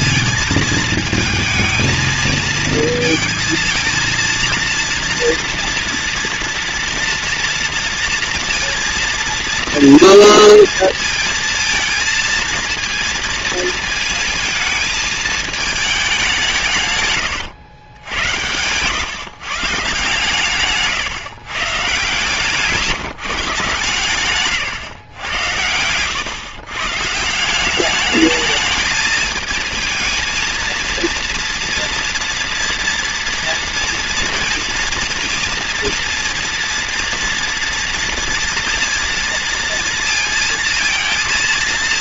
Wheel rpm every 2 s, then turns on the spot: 230, 220, 230, 230, 230, 230, 230, 220, 150, 120, 140, 140, 120, 130, 210, 230, 230, 230, 230, 230, 230.
18-20 24-26